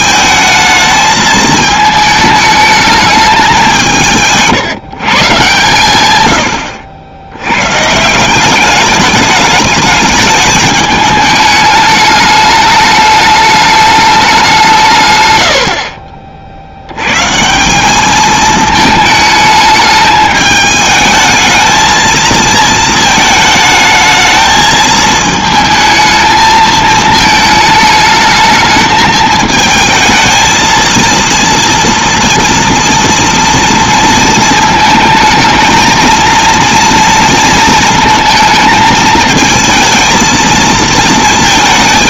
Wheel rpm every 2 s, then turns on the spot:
220, 210, 150, 80, 200, 210, 210, 160, 90, 220, 220, 220, 220, 220, 220, 230, 240, 230, 230, 220, 220.
none